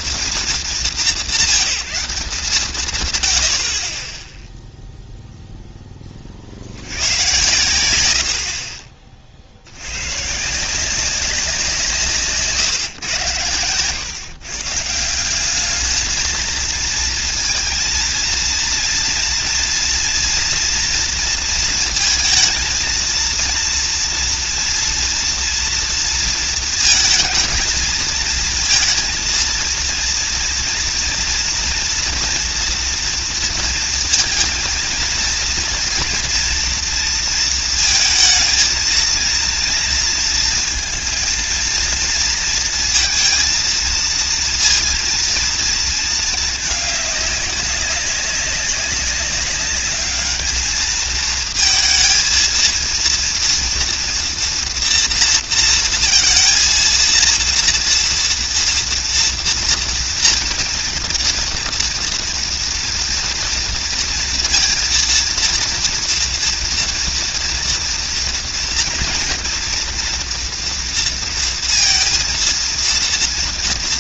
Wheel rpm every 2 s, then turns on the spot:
200, 180, 0, 60, 60, 170, 140, 140, 220, 230, 230, 230, 230, 230, 230, 230, 230, 230, 230, 220, 230, 230, 230, 220, 200, 220, 230, 230, 230, 230, 230, 230, 230, 230, 230, 240, 230.
none